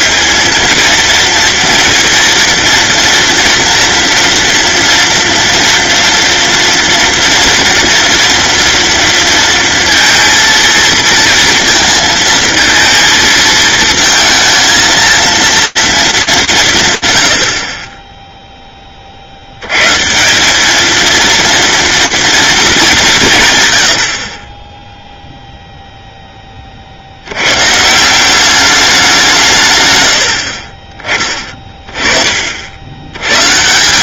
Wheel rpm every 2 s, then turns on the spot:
220, 230, 230, 230, 230, 230, 220, 230, 80, 10, 220, 170, 10, 70, 180, 20, 90.
none